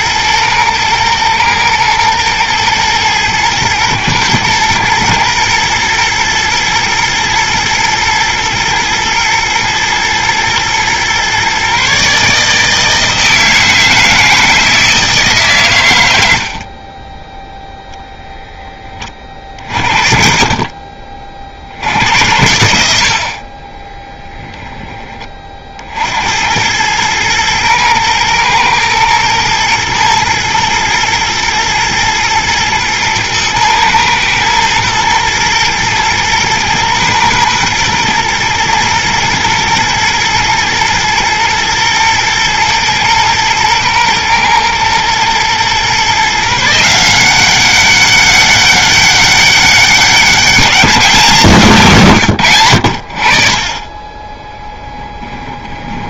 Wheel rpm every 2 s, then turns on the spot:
110, 110, 110, 110, 110, 120, 160, 160, 40, 20, 40, 70, 10, 110, 110, 110, 110, 120, 120, 110, 120, 120, 110, 160, 200, 200, 70, 10.
16-18 22-24 54-56